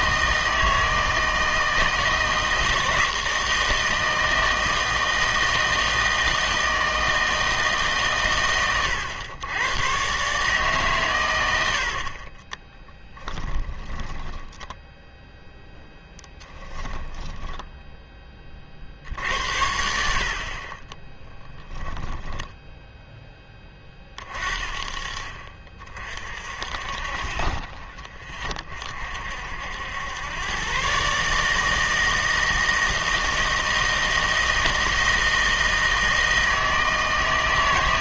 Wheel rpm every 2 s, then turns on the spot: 160, 160, 160, 160, 110, 140, 30, 10, 10, 30, 50, 10, 40, 50, 30, 120, 160, 160, 160.
12-18 22-24